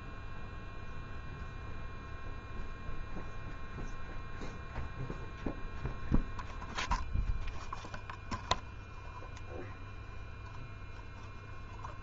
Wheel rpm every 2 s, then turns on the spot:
0, 0, 0, 0, 0, 0.
none